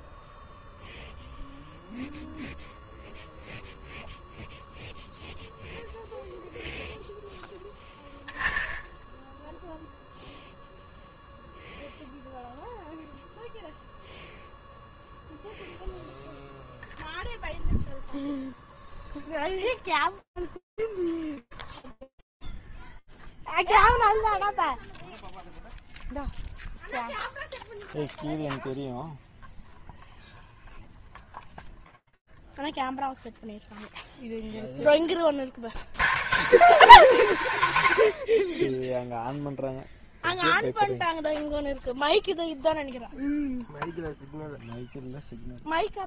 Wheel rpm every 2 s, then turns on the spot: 0, 0, 0, 0, 10, 0, 0, 0, 0, 0, 0, 0, 0, 0, 0, 0, 0, 40, 120, 0, 0, 0, 20.
none